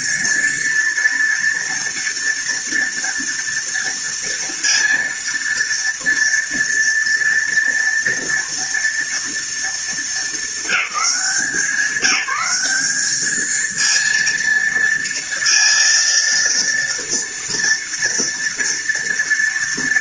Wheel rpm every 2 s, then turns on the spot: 220, 230, 230, 230, 230, 210, 210, 230, 230, 230.
none